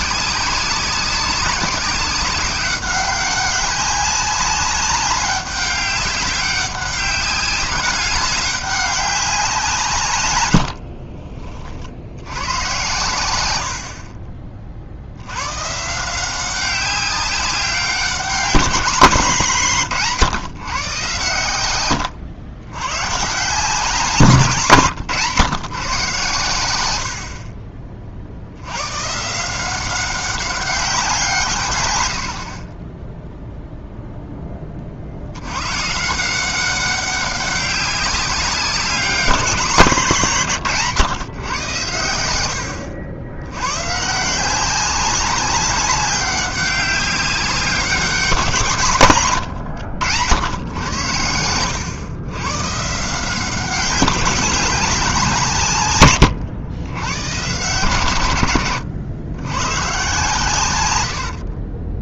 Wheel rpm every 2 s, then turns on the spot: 190, 190, 200, 200, 190, 90, 110, 40, 190, 190, 140, 110, 160, 110, 80, 200, 40, 20, 190, 190, 160, 90, 180, 190, 160, 100, 130, 190, 100, 110, 120.
10-12 24-26